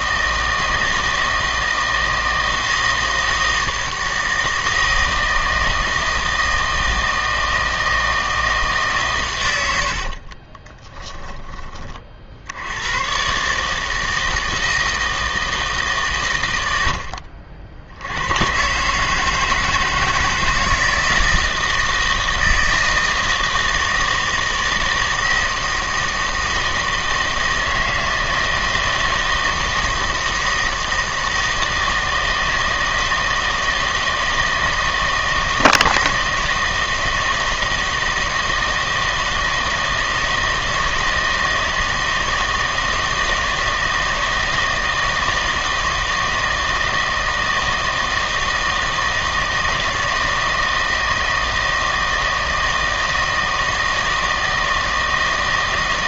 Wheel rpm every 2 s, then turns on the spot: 160, 160, 160, 160, 140, 20, 90, 160, 90, 130, 160, 160, 160, 160, 160, 160, 160, 160, 160, 160, 160, 160, 160, 160, 160, 160, 160, 160.
10-12